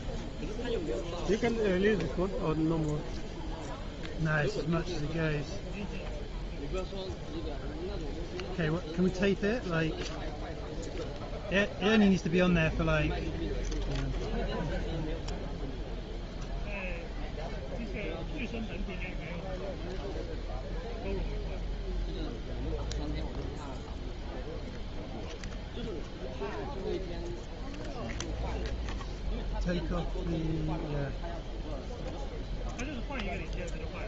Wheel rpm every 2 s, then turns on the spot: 0, 0, 0, 0, 0, 0, 0, 0, 0, 0, 0, 0, 0, 0, 0, 0, 0.
none